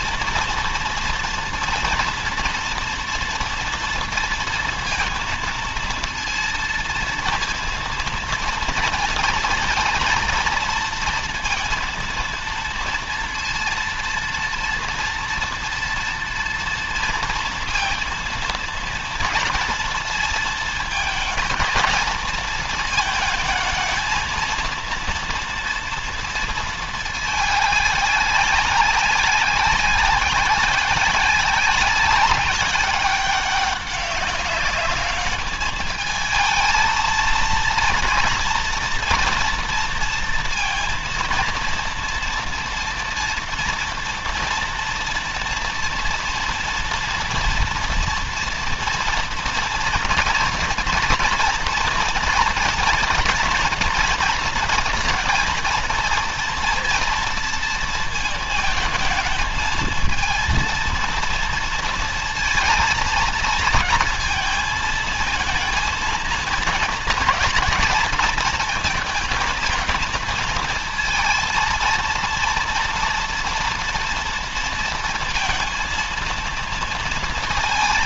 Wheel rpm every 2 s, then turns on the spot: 230, 230, 230, 230, 230, 230, 230, 230, 230, 230, 220, 220, 230, 220, 190, 190, 190, 200, 230, 230, 230, 230, 230, 230, 230, 230, 240, 230, 230, 220, 230, 230, 220, 230, 230, 230, 230, 230, 230.
none